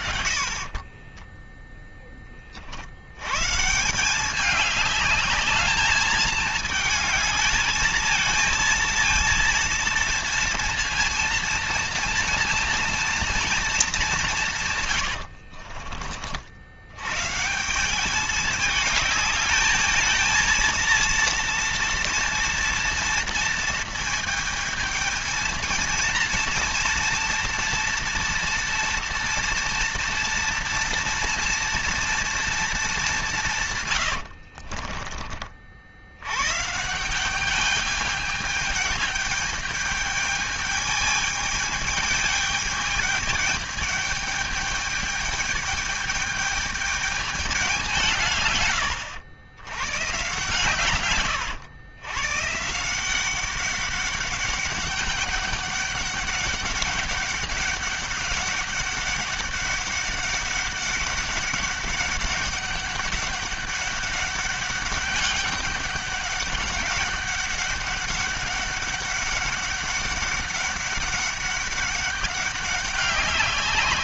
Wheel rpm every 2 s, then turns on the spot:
40, 40, 200, 220, 220, 230, 230, 160, 70, 210, 230, 230, 220, 230, 230, 230, 220, 60, 130, 210, 210, 210, 210, 210, 100, 130, 160, 200, 200, 200, 200, 200, 200, 200, 200, 200, 190.
0-2 14-16 34-36